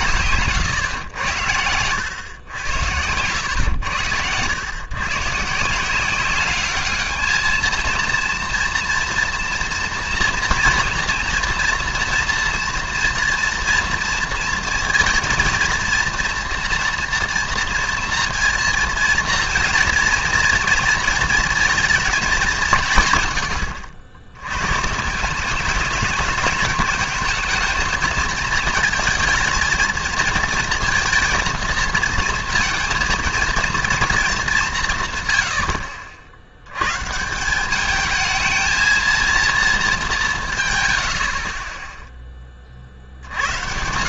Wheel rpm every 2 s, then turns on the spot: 140, 100, 110, 200, 230, 230, 240, 230, 230, 230, 230, 200, 110, 210, 220, 230, 230, 180, 110, 220, 130, 40.
0-2